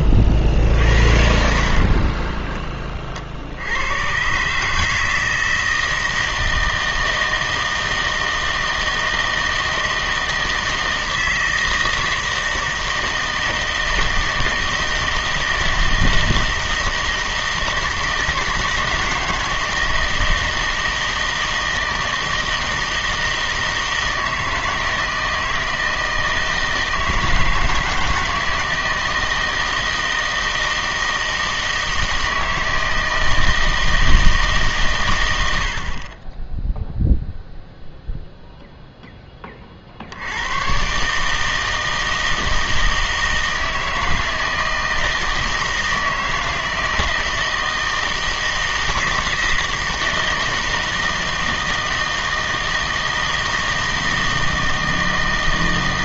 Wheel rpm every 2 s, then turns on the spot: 60, 20, 150, 160, 160, 160, 160, 160, 160, 160, 160, 160, 160, 160, 160, 160, 160, 140, 0, 0, 110, 160, 160, 160, 160, 160, 160, 160.
none